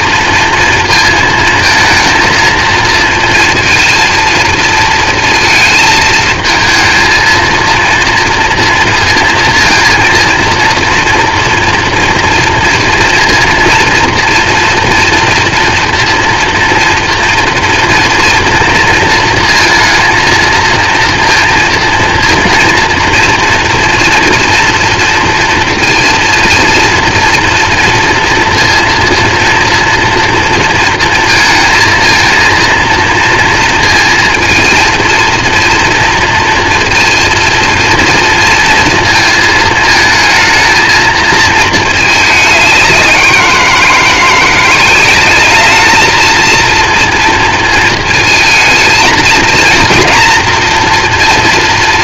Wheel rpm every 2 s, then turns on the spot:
230, 230, 230, 230, 230, 230, 230, 230, 230, 230, 230, 230, 230, 230, 230, 230, 230, 230, 230, 230, 220, 200, 170, 230, 220, 240.
none